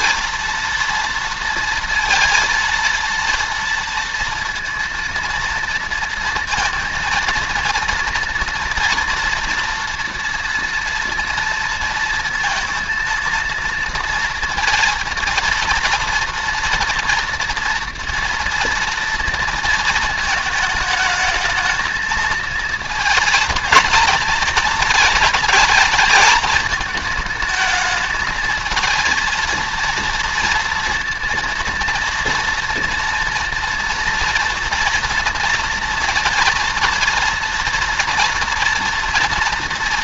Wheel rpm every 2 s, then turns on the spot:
230, 230, 230, 230, 230, 230, 230, 230, 230, 230, 220, 230, 220, 220, 220, 230, 230, 230, 230, 240.
none